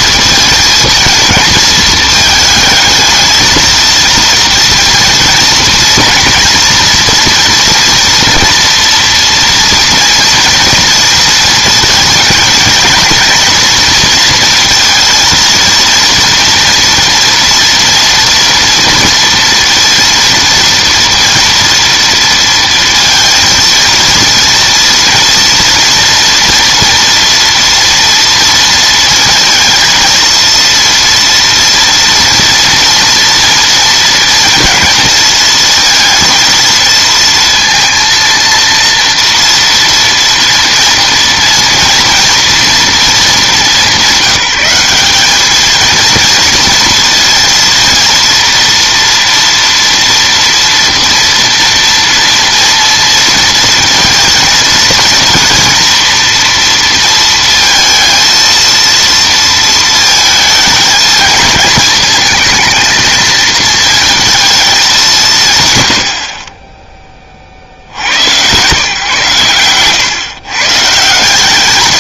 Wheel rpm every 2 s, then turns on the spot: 230, 220, 230, 230, 230, 230, 230, 230, 230, 230, 230, 230, 230, 240, 230, 230, 230, 230, 230, 230, 230, 230, 180, 230, 230, 230, 230, 230, 230, 230, 220, 230, 220, 30, 120, 140.
none